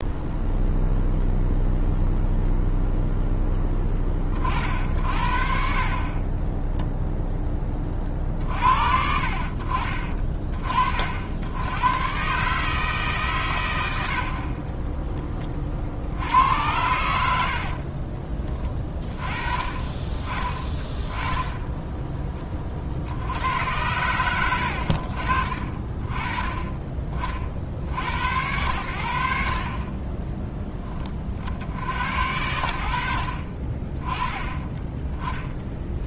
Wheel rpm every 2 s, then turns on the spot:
0, 0, 50, 10, 50, 40, 150, 30, 90, 30, 10, 40, 80, 30, 80, 20, 80, 20.
14-16